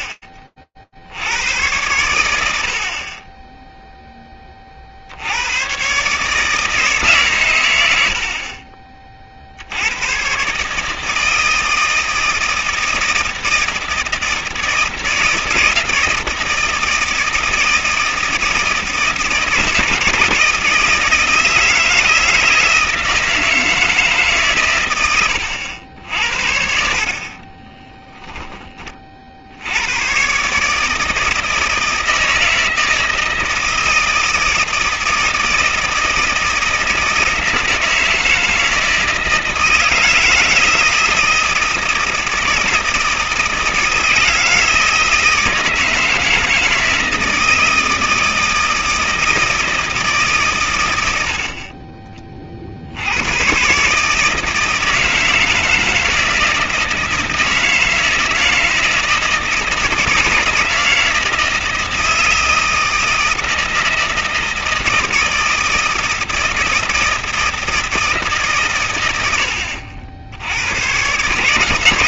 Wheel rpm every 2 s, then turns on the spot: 40, 90, 20, 150, 50, 140, 160, 160, 160, 160, 160, 160, 120, 60, 20, 150, 160, 160, 160, 160, 160, 160, 160, 160, 160, 100, 90, 160, 160, 160, 160, 160, 160, 160, 100, 130.
26-28